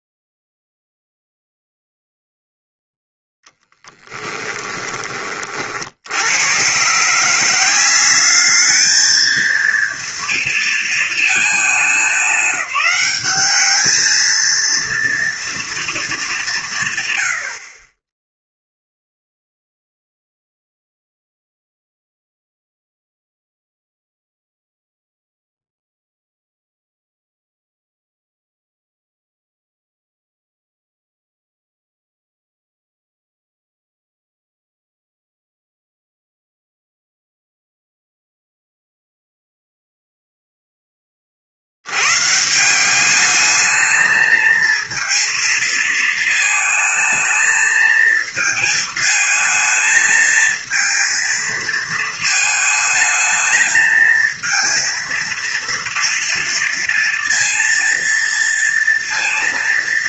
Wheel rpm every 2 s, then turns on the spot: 0, 0, 20, 120, 210, 230, 190, 230, 150, 0, 0, 0, 0, 0, 0, 0, 0, 0, 0, 0, 10, 180, 230, 220, 220, 220, 220, 230, 230, 230.
4-6